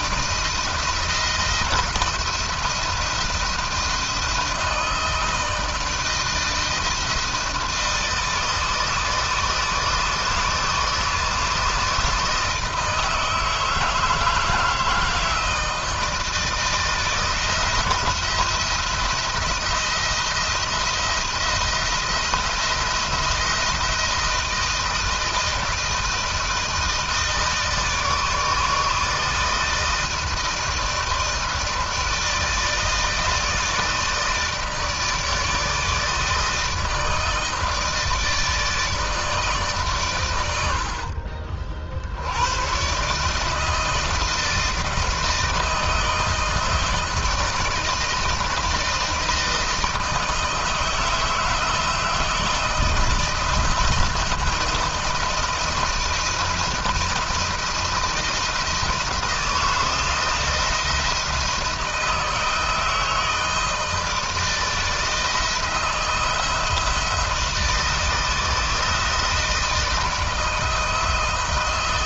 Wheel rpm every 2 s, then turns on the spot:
160, 170, 160, 160, 160, 160, 160, 160, 160, 170, 170, 170, 160, 160, 160, 160, 160, 160, 160, 160, 80, 110, 160, 160, 160, 160, 160, 160, 170, 160, 160, 160, 160, 160, 160, 160.
40-42